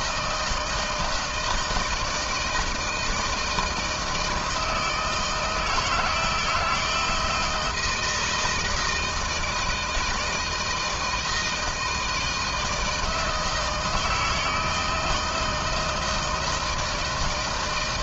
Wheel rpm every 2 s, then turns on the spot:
170, 160, 160, 160, 160, 160, 160, 160, 160.
none